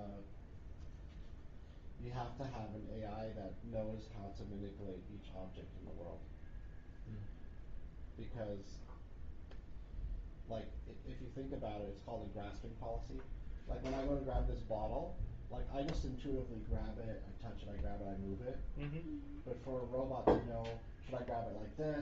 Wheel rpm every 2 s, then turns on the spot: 0, 0, 0, 0, 0, 0, 0, 0, 0, 0, 0.
none